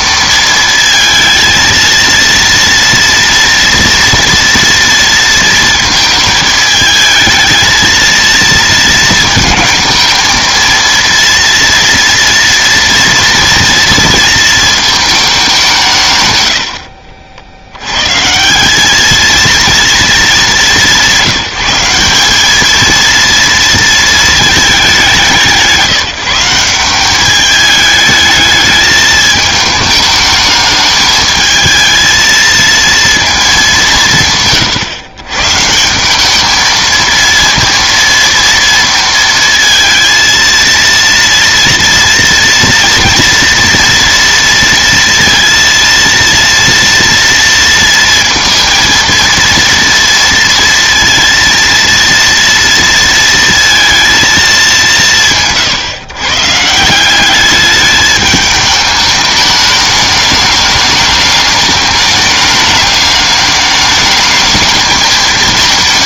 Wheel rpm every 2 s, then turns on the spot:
220, 230, 230, 220, 230, 230, 230, 230, 110, 190, 190, 220, 210, 180, 210, 210, 230, 140, 220, 230, 230, 230, 230, 230, 230, 230, 230, 200, 160, 210, 210, 210, 210.
none